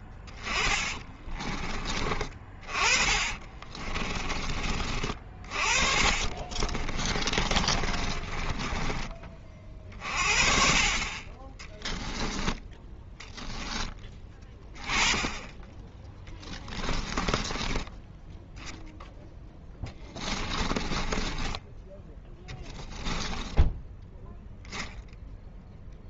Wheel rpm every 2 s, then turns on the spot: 20, 30, 30, 30, 20, 40, 10, 20, 10, 10, 20, 10, 0.
0-4 6-10 16-18 20-22